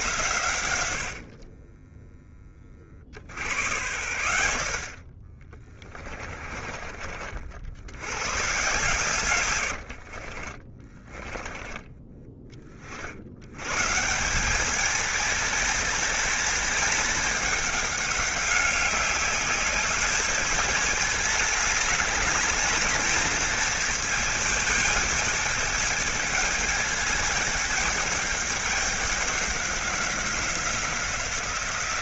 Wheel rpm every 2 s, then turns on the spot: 100, 40, 40, 40, 130, 30, 40, 210, 210, 200, 210, 220, 220, 210, 200, 180.
0-2 10-12